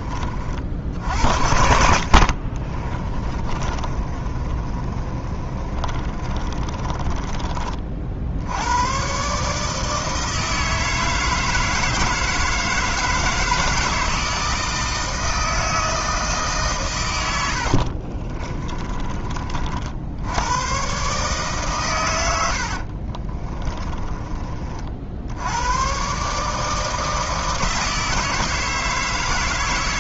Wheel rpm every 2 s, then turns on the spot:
60, 30, 30, 20, 110, 160, 160, 160, 130, 20, 120, 70, 50, 160, 160.
2-8 18-20 22-24